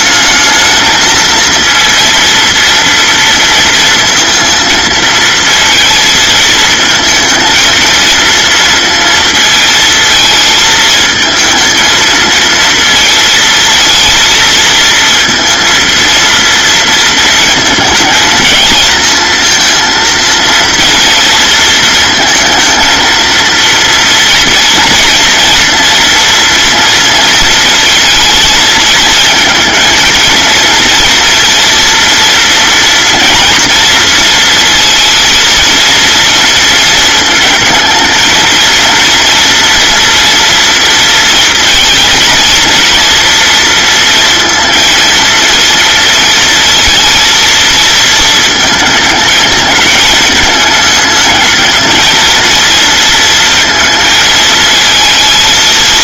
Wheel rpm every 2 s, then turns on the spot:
220, 230, 230, 220, 230, 220, 230, 230, 230, 220, 230, 230, 230, 230, 230, 230, 230, 230, 230, 230, 230, 230, 230, 230, 220, 210, 230, 220.
none